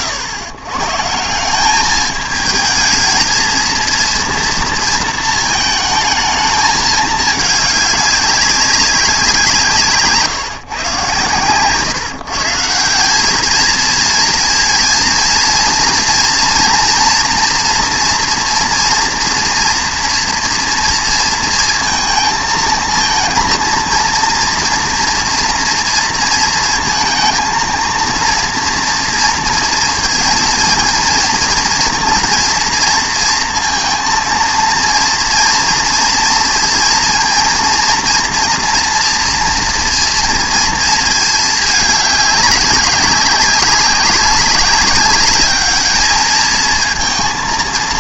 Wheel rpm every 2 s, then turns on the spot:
110, 220, 230, 220, 200, 140, 160, 230, 230, 230, 240, 230, 240, 230, 230, 230, 240, 230, 230, 230, 230, 200, 200, 220.
none